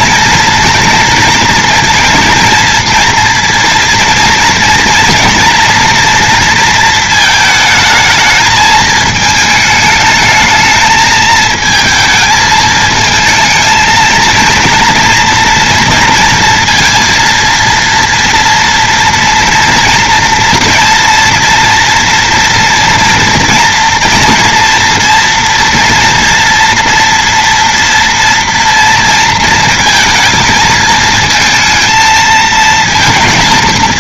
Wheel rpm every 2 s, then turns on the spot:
230, 230, 230, 230, 220, 220, 220, 240, 230, 230, 230, 230, 230, 230, 230, 220, 230.
none